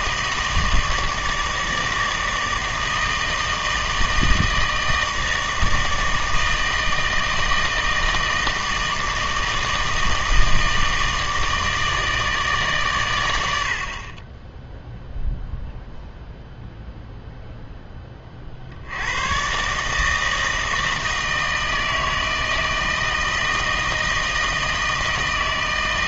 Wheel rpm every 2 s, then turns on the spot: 160, 160, 160, 160, 160, 160, 140, 10, 0, 60, 160, 160, 160.
none